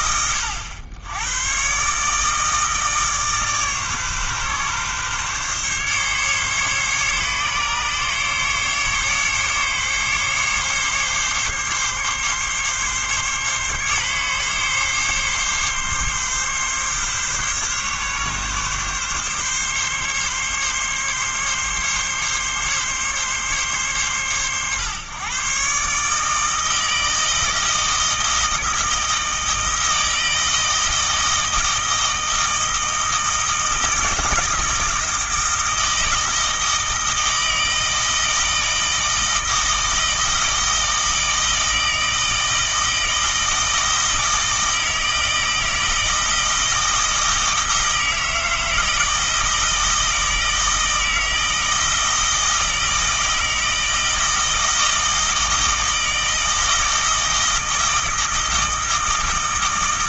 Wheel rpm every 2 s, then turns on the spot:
90, 150, 130, 140, 140, 140, 140, 140, 140, 140, 140, 140, 110, 160, 160, 160, 160, 160, 160, 160, 160, 160, 160, 160, 160, 160, 160, 160, 160, 160.
none